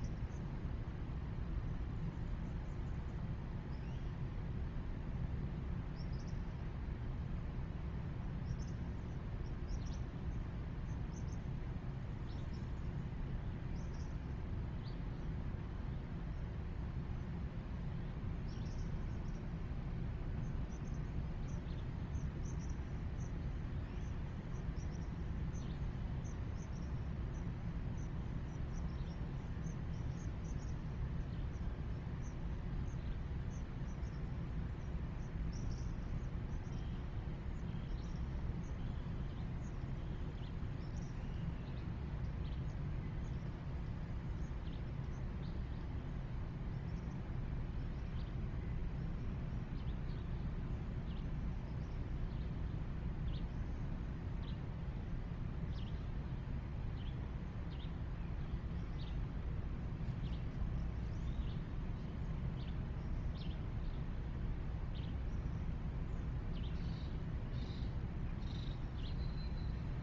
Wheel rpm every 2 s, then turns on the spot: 0, 0, 0, 0, 0, 0, 0, 0, 0, 0, 0, 0, 0, 0, 0, 0, 0, 0, 0, 0, 0, 0, 0, 0, 0, 0, 0, 0, 0, 0, 0, 0, 0, 0, 0.
none